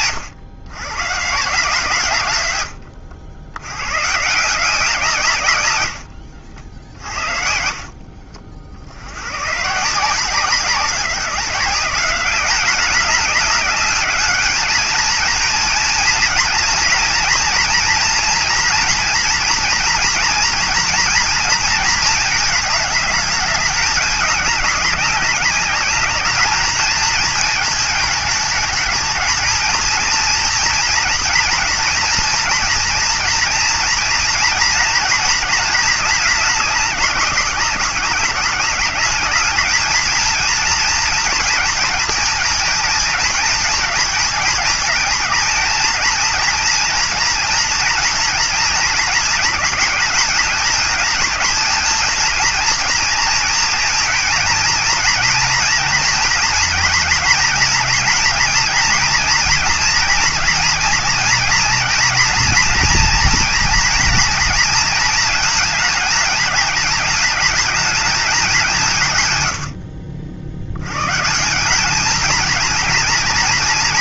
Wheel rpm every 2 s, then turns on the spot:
130, 90, 170, 60, 80, 180, 200, 220, 230, 230, 230, 210, 200, 220, 220, 230, 230, 230, 210, 200, 230, 230, 220, 230, 230, 220, 230, 230, 230, 240, 230, 240, 230, 220, 170, 100, 230.
none